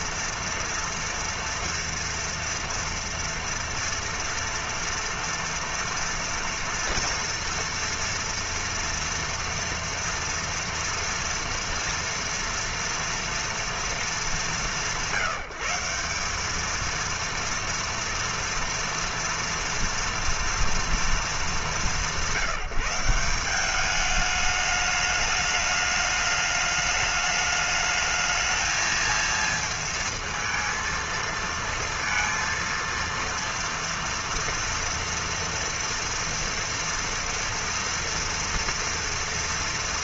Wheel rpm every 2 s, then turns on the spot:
230, 230, 240, 230, 230, 230, 230, 170, 210, 230, 230, 170, 210, 210, 220, 230, 230, 230, 230, 230.
none